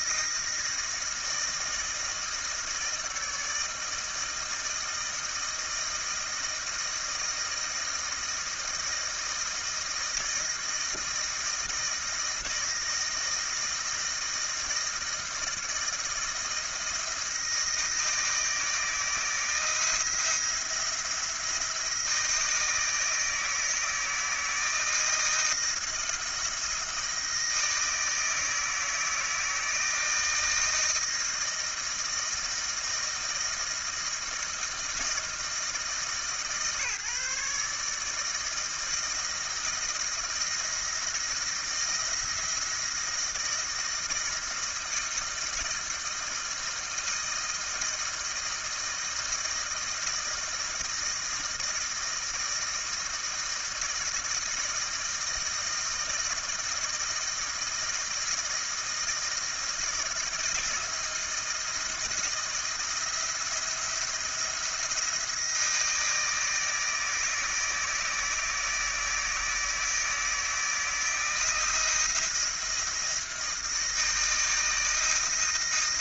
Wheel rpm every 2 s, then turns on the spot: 160, 160, 160, 160, 160, 160, 160, 160, 160, 160, 170, 160, 160, 160, 160, 160, 160, 160, 150, 160, 160, 170, 160, 160, 160, 160, 160, 160, 160, 160, 160, 170, 170, 160, 160, 160, 170, 160.
none